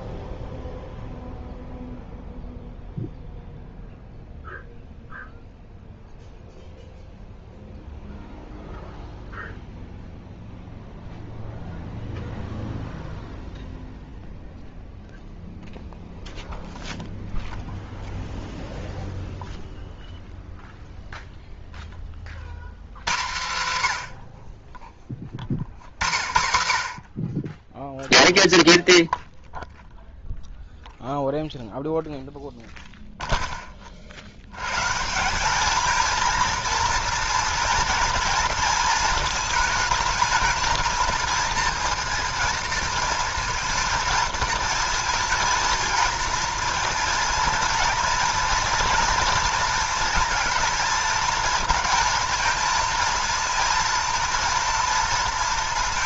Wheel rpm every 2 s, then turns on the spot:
0, 0, 0, 0, 0, 0, 0, 0, 0, 0, 0, 110, 30, 60, 0, 0, 0, 130, 230, 220, 220, 230, 230, 230, 230, 220, 220, 230.
none